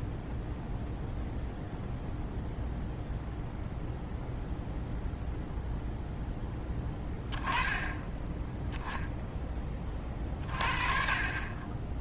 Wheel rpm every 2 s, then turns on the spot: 0, 0, 0, 10, 10, 40.
none